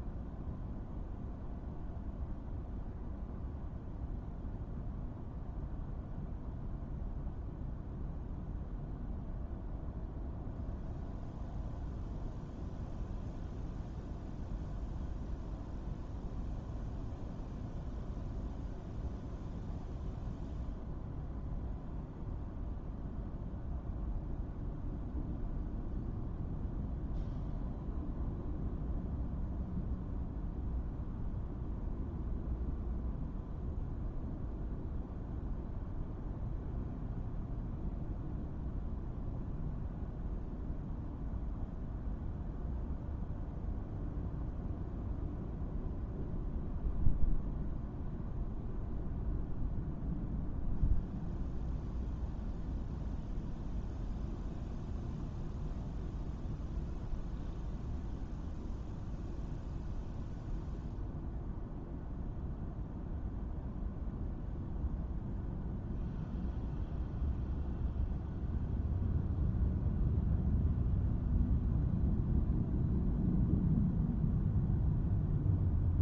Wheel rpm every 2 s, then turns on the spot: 0, 0, 0, 0, 0, 0, 0, 0, 0, 0, 0, 0, 0, 0, 0, 0, 0, 0, 0, 0, 0, 0, 0, 0, 0, 0, 0, 0, 0, 0, 0, 0, 0, 0, 0, 0, 0, 0.
none